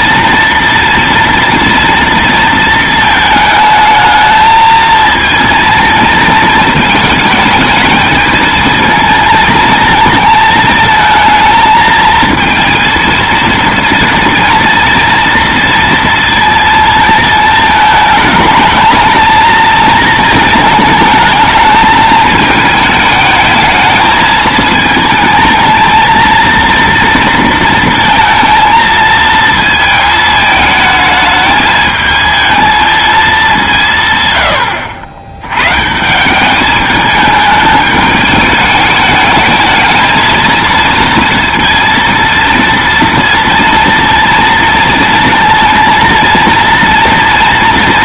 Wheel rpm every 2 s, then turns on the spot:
230, 220, 220, 220, 220, 220, 230, 230, 230, 210, 220, 220, 220, 230, 230, 220, 220, 100, 210, 210, 230, 230, 230, 230.
34-36